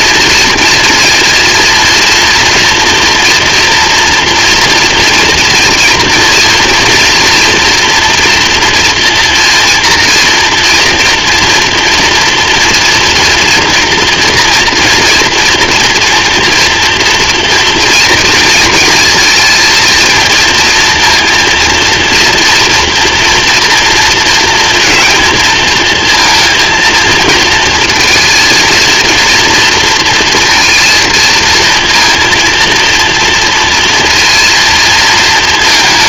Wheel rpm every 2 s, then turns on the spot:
230, 230, 230, 230, 230, 230, 240, 230, 240, 230, 230, 240, 230, 230, 230, 230, 230, 230.
none